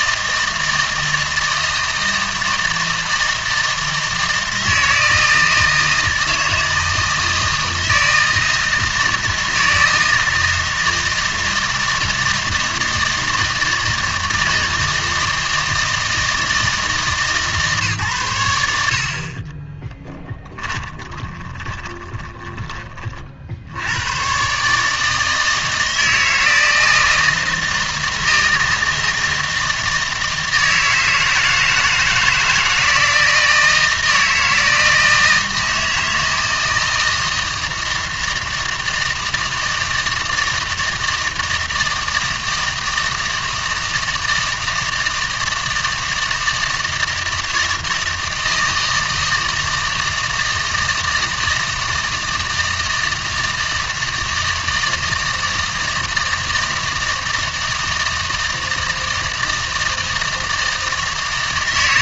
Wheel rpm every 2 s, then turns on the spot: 160, 160, 160, 160, 160, 160, 160, 160, 160, 80, 10, 20, 140, 160, 160, 160, 160, 160, 160, 160, 160, 160, 160, 160, 160, 160, 160, 160, 160, 160, 160.
20-22